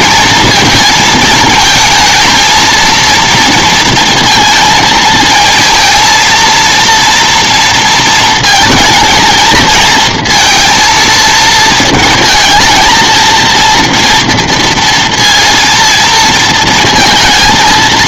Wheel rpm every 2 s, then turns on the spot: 220, 230, 230, 230, 230, 230, 220, 230, 230.
none